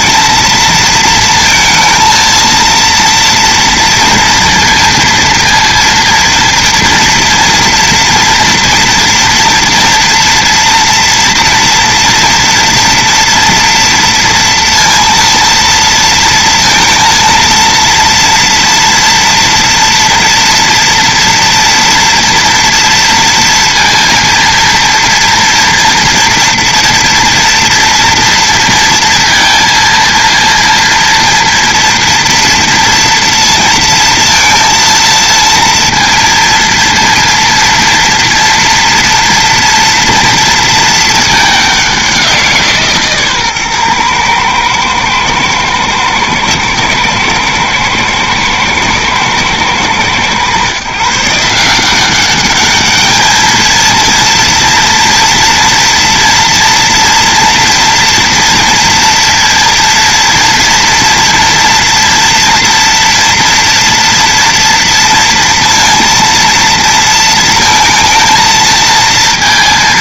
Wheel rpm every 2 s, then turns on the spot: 230, 230, 230, 230, 230, 230, 230, 230, 230, 230, 230, 230, 230, 230, 230, 230, 230, 230, 230, 230, 230, 160, 110, 110, 110, 130, 210, 230, 240, 230, 240, 230, 230, 230, 220.
none